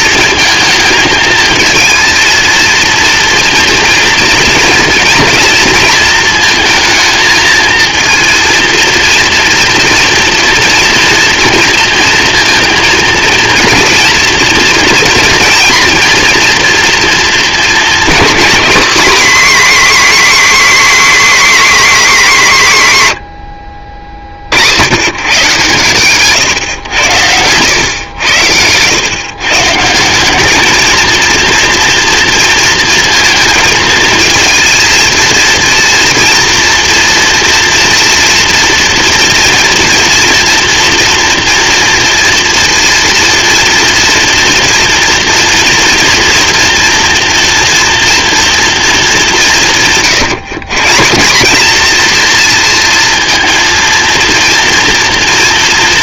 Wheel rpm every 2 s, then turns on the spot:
220, 230, 230, 230, 230, 230, 230, 230, 240, 260, 280, 180, 100, 120, 100, 220, 230, 230, 230, 240, 230, 230, 230, 240, 220, 150, 230, 230.
none